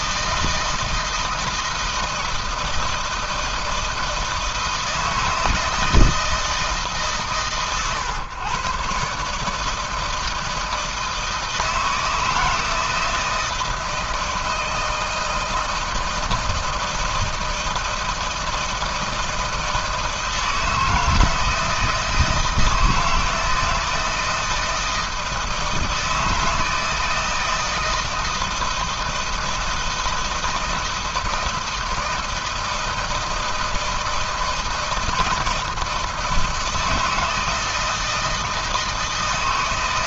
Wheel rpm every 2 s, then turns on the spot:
160, 160, 160, 150, 120, 160, 160, 160, 160, 160, 160, 160, 160, 160, 160, 160, 160, 160, 160, 160.
none